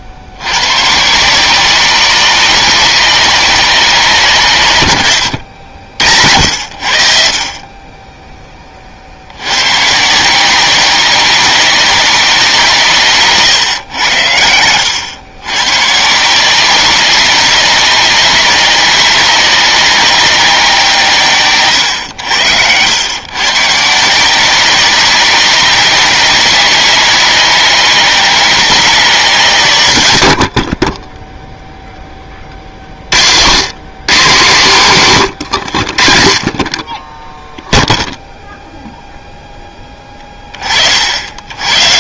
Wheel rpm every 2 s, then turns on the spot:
150, 190, 110, 60, 40, 190, 160, 100, 190, 190, 160, 100, 190, 190, 180, 30, 50, 130, 30, 0, 30.
none